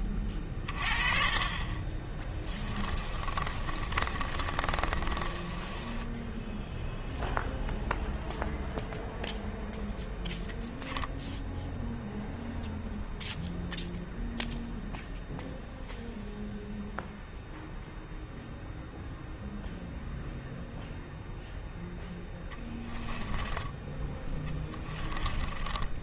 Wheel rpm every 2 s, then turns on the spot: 30, 20, 30, 0, 0, 0, 0, 0, 0, 0, 0, 10, 20.
2-6 22-26